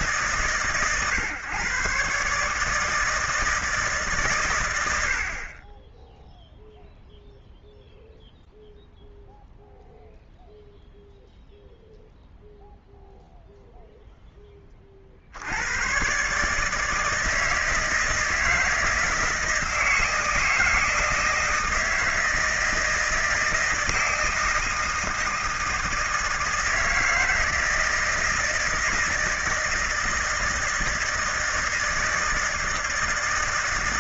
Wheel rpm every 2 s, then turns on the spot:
130, 160, 80, 0, 0, 0, 0, 40, 160, 160, 160, 170, 160, 160, 160, 160, 160.
none